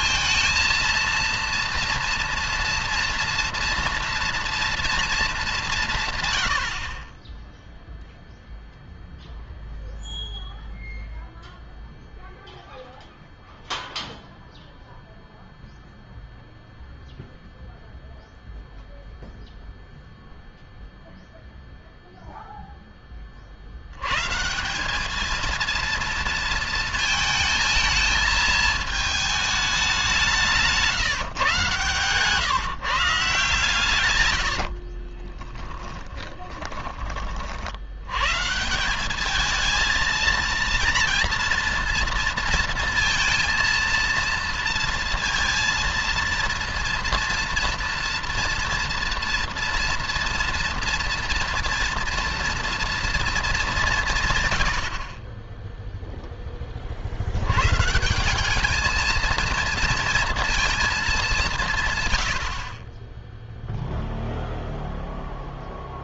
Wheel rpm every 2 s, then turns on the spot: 230, 230, 230, 50, 0, 0, 0, 0, 0, 0, 0, 20, 200, 230, 220, 150, 140, 40, 30, 190, 230, 230, 230, 230, 230, 230, 230, 70, 50, 220, 210, 30, 0.
34-36